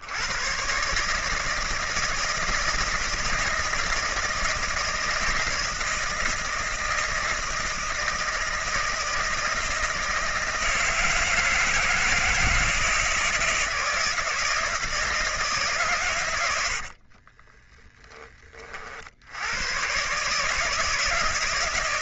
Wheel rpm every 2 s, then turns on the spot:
130, 160, 160, 160, 160, 160, 160, 160, 70, 50, 150.
16-18